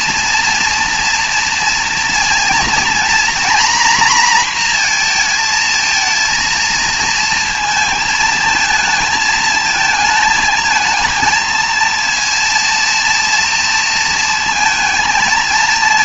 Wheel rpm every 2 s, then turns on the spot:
230, 230, 240, 230, 220, 220, 230, 230.
none